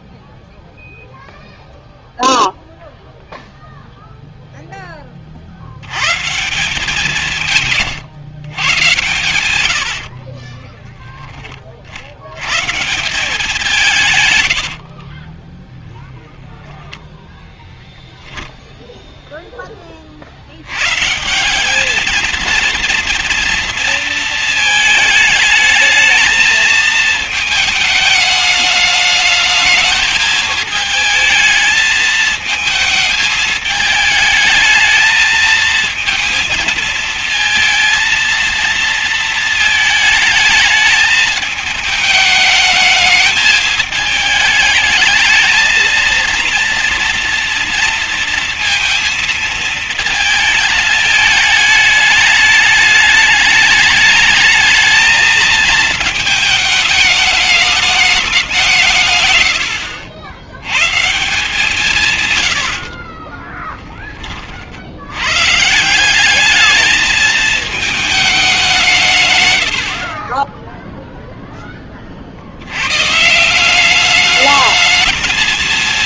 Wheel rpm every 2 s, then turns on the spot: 0, 0, 10, 180, 120, 20, 130, 90, 0, 10, 100, 230, 220, 220, 210, 220, 220, 220, 230, 230, 210, 210, 220, 230, 230, 220, 210, 220, 220, 170, 110, 90, 40, 200, 200, 30, 60, 210.
10-12 14-16